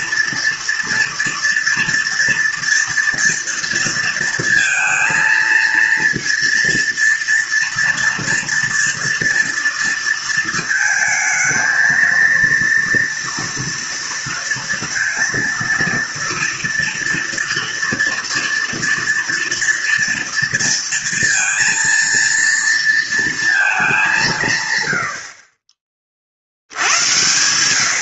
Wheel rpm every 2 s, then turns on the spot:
240, 230, 230, 230, 230, 220, 230, 230, 230, 230, 230, 230, 120, 120.
none